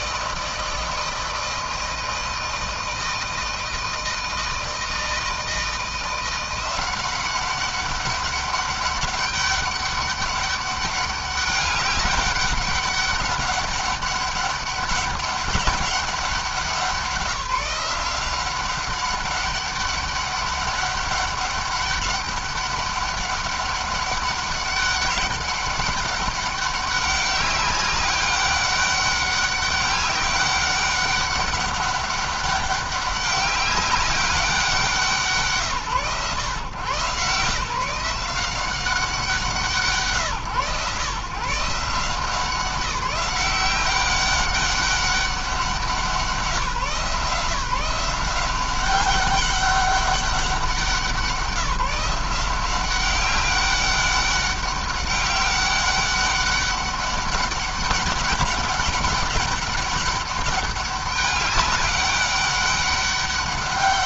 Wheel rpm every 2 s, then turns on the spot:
160, 160, 160, 180, 200, 200, 200, 200, 190, 190, 200, 200, 200, 200, 200, 200, 200, 190, 140, 180, 130, 180, 200, 180, 180, 180, 180, 190, 190, 200, 200, 200.
none